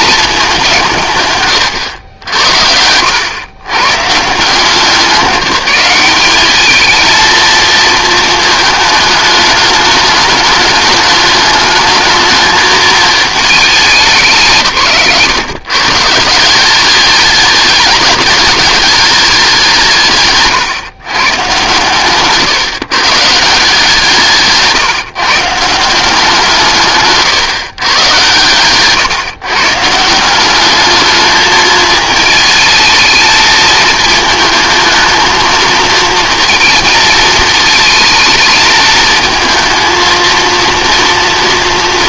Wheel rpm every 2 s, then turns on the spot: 120, 110, 190, 220, 210, 210, 220, 140, 210, 200, 140, 160, 140, 140, 140, 220, 220, 230, 220, 220, 230.
none